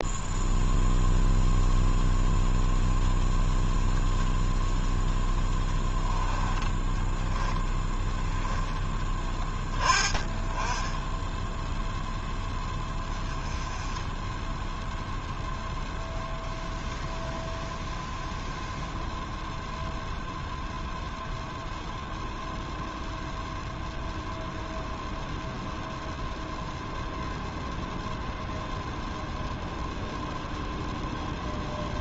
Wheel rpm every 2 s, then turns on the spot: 0, 0, 0, 10, 10, 10, 10, 0, 0, 0, 0, 0, 0, 0, 0, 0.
6-8